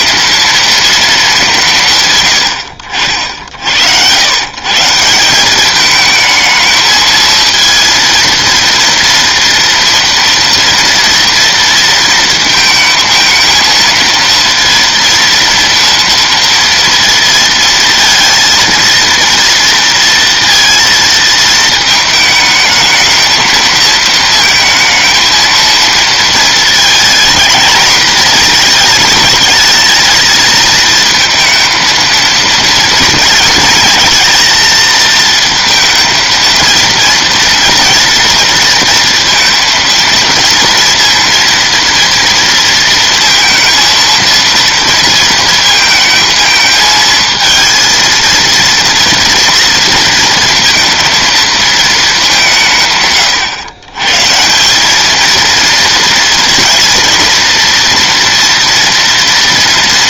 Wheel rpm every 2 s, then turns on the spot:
230, 70, 140, 220, 230, 230, 220, 230, 230, 230, 230, 220, 220, 220, 220, 220, 230, 230, 230, 230, 230, 230, 230, 220, 230, 220, 160, 180, 230, 230.
none